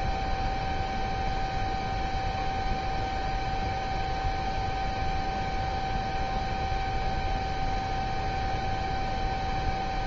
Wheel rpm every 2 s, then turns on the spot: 0, 0, 0, 0, 0.
none